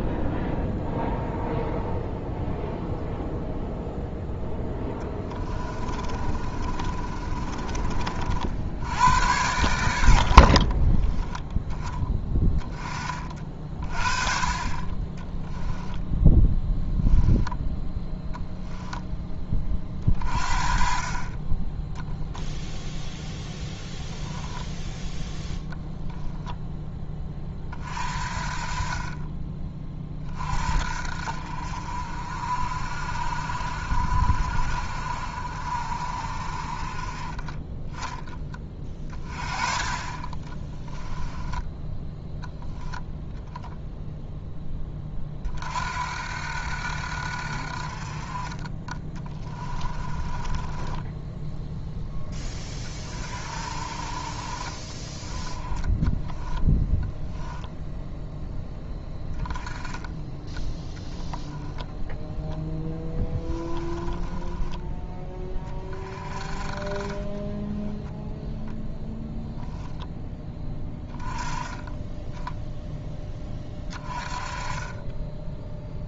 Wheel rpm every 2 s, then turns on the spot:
0, 0, 10, 30, 80, 40, 20, 30, 0, 0, 40, 0, 0, 10, 40, 40, 50, 50, 40, 20, 10, 0, 10, 70, 20, 20, 20, 30, 10, 10, 10, 0, 10, 20, 0, 10, 10, 20.
4-8 10-12 40-42 48-52 56-58